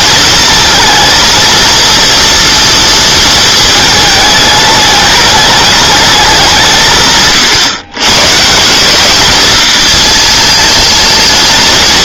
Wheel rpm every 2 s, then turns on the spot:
230, 230, 210, 160, 190, 220.
none